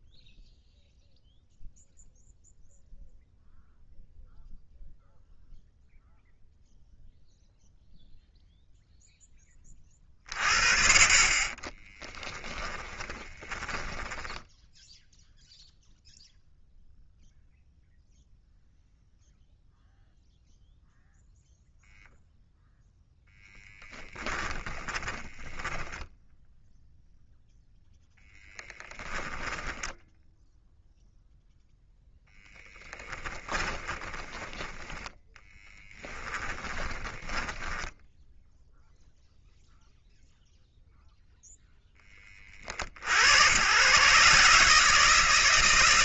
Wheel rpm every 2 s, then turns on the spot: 0, 0, 0, 0, 0, 40, 20, 10, 0, 0, 0, 0, 20, 0, 10, 0, 20, 10, 20, 0, 0, 40, 140.
12-16 24-26 32-38